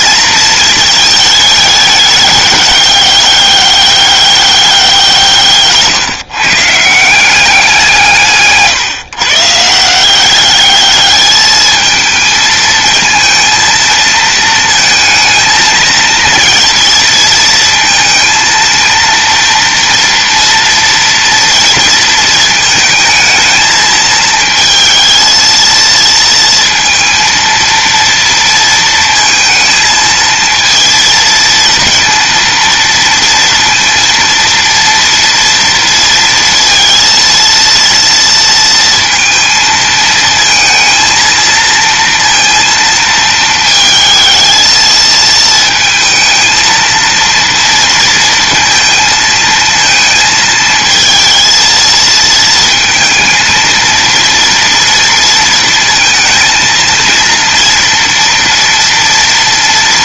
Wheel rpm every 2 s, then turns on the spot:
220, 200, 170, 180, 140, 210, 230, 220, 230, 230, 230, 220, 220, 230, 230, 220, 230, 230, 230, 230, 230, 220, 220, 230, 220, 230, 230, 230, 230, 230.
none